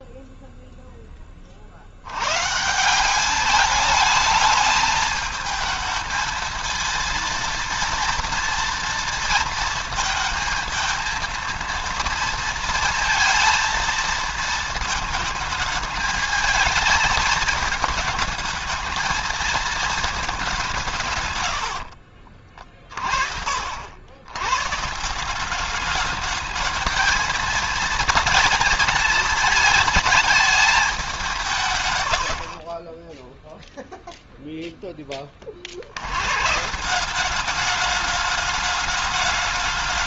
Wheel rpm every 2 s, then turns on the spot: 10, 170, 220, 230, 230, 230, 230, 220, 220, 220, 160, 40, 160, 220, 230, 200, 20, 10, 180, 210.
none